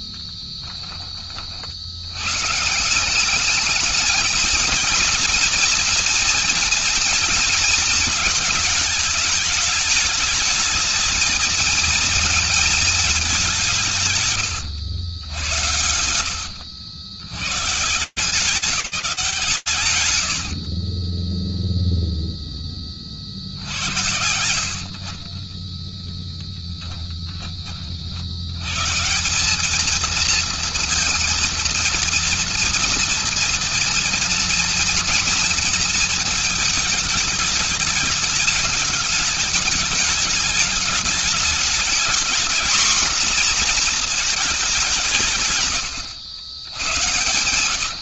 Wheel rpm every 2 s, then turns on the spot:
40, 100, 220, 230, 210, 210, 230, 140, 80, 160, 110, 0, 80, 10, 140, 230, 230, 230, 220, 220, 210, 240, 190, 100.
0-2 14-18 20-22 26-28